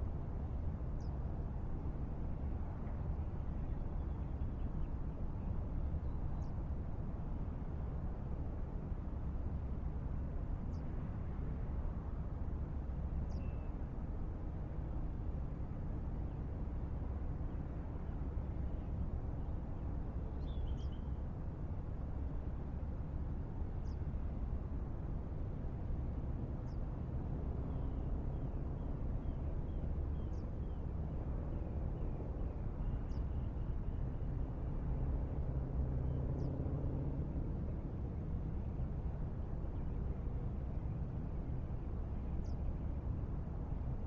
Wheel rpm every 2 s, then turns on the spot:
0, 0, 0, 0, 0, 0, 0, 0, 0, 0, 0, 0, 0, 0, 0, 0, 0, 0, 0, 0, 0, 0.
none